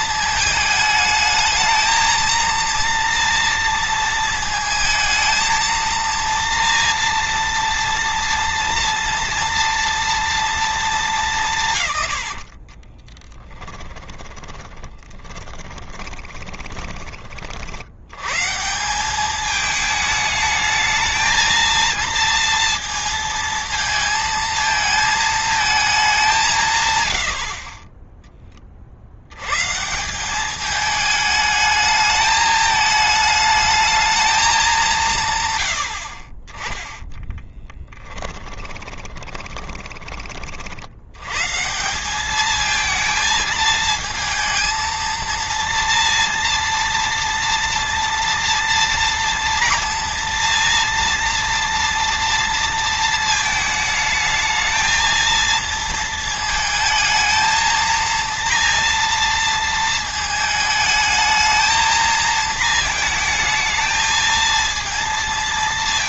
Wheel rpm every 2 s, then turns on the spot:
220, 230, 220, 230, 230, 220, 50, 10, 20, 140, 220, 230, 220, 170, 20, 200, 220, 200, 30, 10, 50, 210, 230, 230, 230, 230, 230, 220, 220, 230, 220, 220, 230.
12-18 38-40